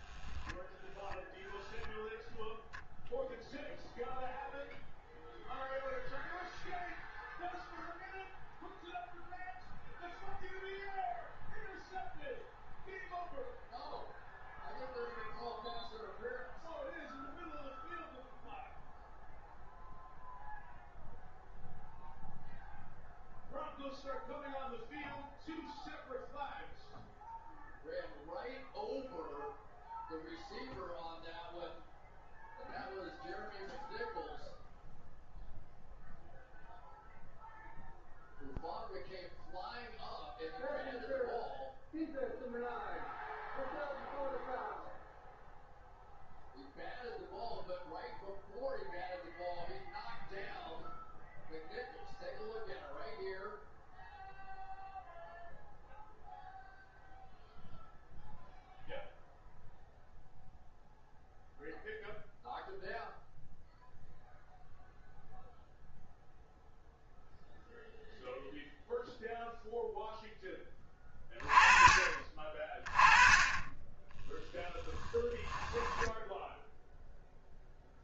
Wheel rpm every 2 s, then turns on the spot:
0, 0, 0, 0, 0, 0, 0, 0, 0, 0, 0, 0, 0, 0, 0, 0, 0, 0, 0, 0, 0, 0, 0, 0, 0, 0, 0, 0, 0, 0, 0, 0, 0, 0, 0, 10, 30, 10, 0.
none